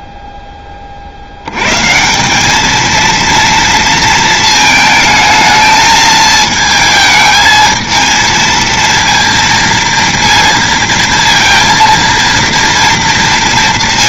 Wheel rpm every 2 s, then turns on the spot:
30, 210, 220, 220, 230, 230, 230.
none